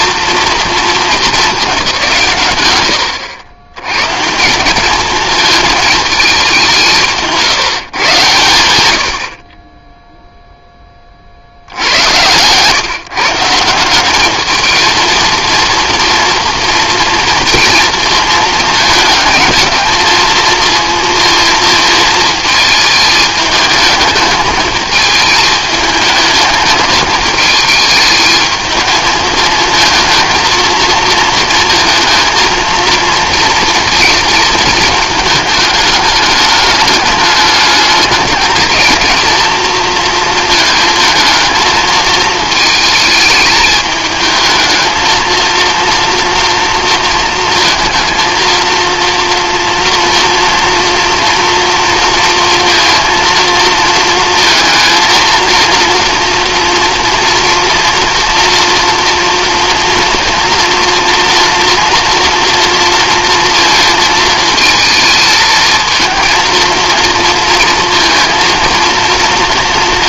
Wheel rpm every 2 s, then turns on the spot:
210, 90, 220, 160, 60, 60, 160, 230, 230, 220, 230, 210, 220, 220, 220, 230, 220, 220, 210, 220, 220, 210, 230, 220, 230, 230, 230, 230, 230, 230, 230, 230, 220, 230, 230.
none